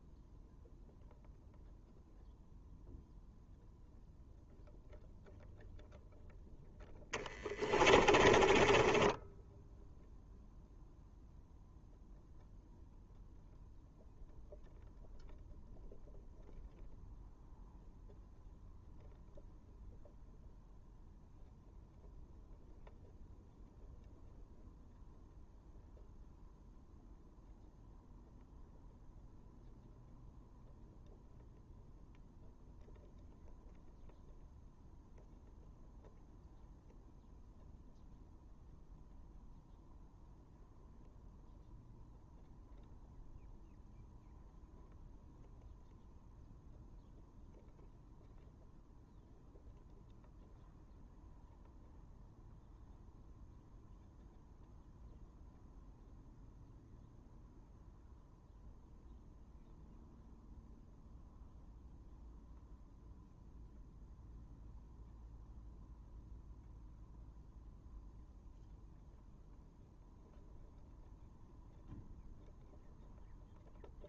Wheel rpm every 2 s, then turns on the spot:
0, 0, 0, 0, 20, 0, 0, 0, 0, 0, 0, 0, 0, 0, 0, 0, 0, 0, 0, 0, 0, 0, 0, 0, 0, 0, 0, 0, 0, 0, 0, 0, 0, 0, 0, 0, 0.
8-10